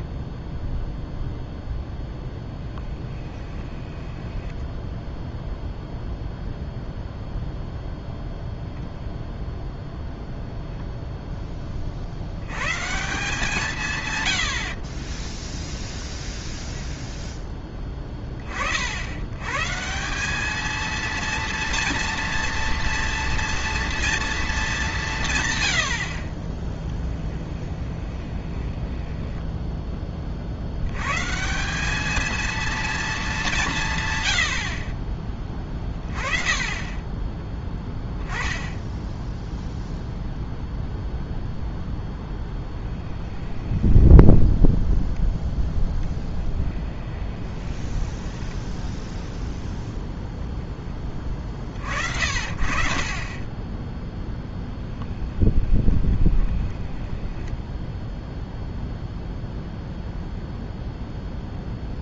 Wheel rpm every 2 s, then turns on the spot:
0, 10, 10, 0, 0, 0, 140, 60, 0, 40, 210, 230, 210, 20, 20, 90, 230, 50, 20, 10, 0, 10, 0, 10, 10, 10, 40, 10, 10, 0, 0.
2-6 14-16 26-30 46-50 56-58